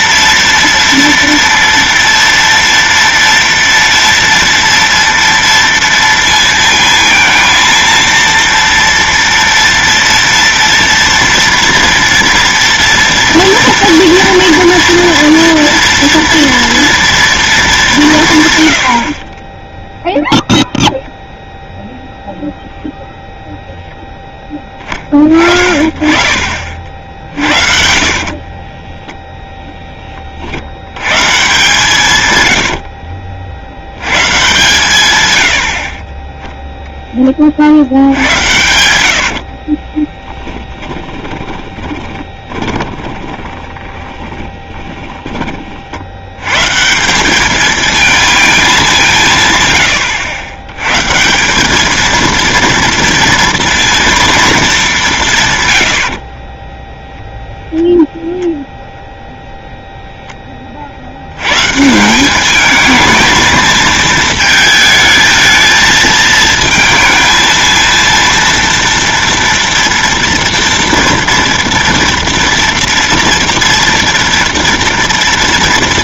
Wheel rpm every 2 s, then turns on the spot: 230, 230, 230, 230, 230, 230, 230, 230, 230, 70, 0, 0, 20, 50, 20, 110, 70, 140, 0, 80, 10, 20, 10, 140, 200, 110, 230, 200, 10, 0, 40, 220, 220, 220, 230, 230, 230, 230.
18-20 28-30 32-34 40-46 56-58